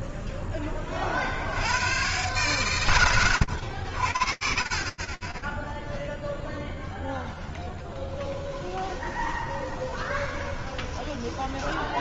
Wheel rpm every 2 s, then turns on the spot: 10, 120, 40, 0, 20, 10.
8-12